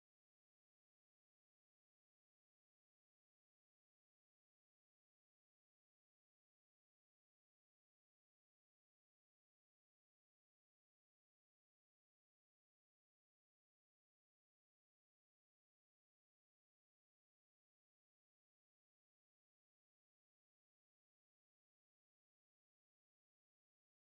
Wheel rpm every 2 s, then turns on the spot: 0, 0, 0, 0, 0, 0, 10, 0, 0, 20, 0, 10.
12-14